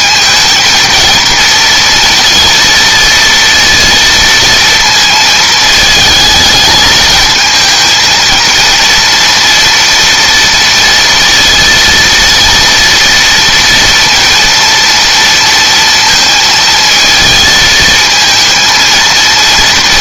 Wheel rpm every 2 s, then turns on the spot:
230, 230, 230, 220, 230, 230, 230, 230, 220, 220.
none